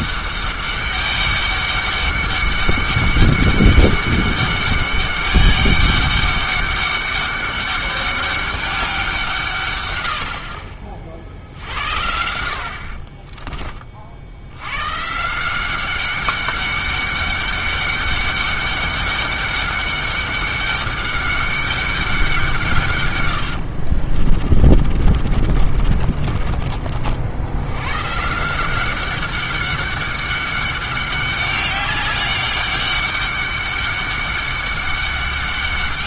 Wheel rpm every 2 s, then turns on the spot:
200, 200, 200, 200, 200, 50, 60, 90, 200, 200, 200, 160, 30, 40, 170, 200, 200, 200.
24-26